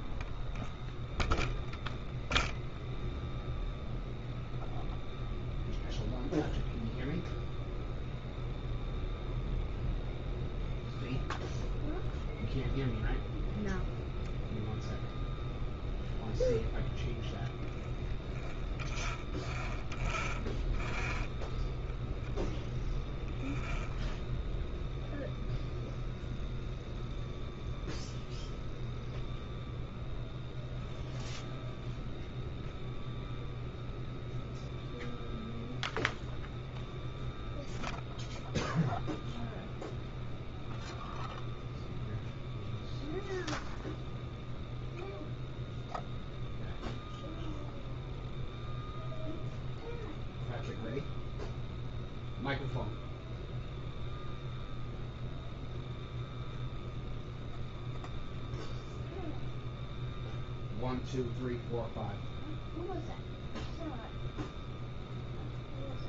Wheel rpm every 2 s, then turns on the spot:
0, 0, 0, 0, 0, 0, 0, 0, 0, 0, 0, 0, 0, 0, 0, 0, 0, 0, 0, 0, 0, 0, 0, 0, 0, 0, 0, 0, 0, 0, 0, 0, 0.
none